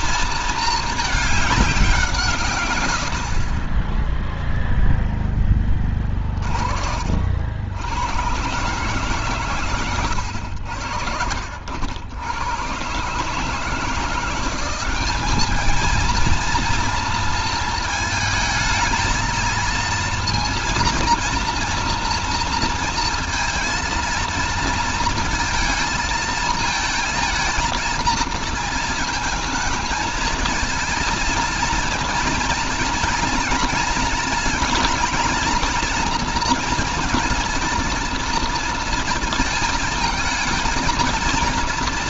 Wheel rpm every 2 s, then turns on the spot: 220, 100, 0, 30, 130, 80, 120, 190, 230, 220, 230, 230, 230, 230, 230, 230, 230, 230, 230, 230, 230.
2-4